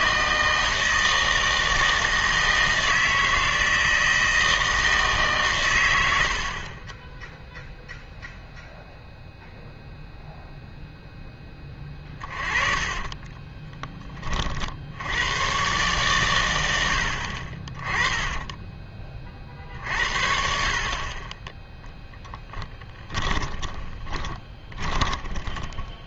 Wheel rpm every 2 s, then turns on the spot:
160, 160, 160, 40, 0, 0, 20, 50, 100, 20, 60, 10, 30.
12-14 18-20 22-26